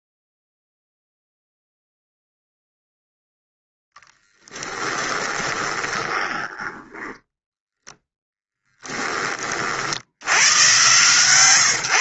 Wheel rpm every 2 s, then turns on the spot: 0, 0, 10, 20, 10, 110.
4-8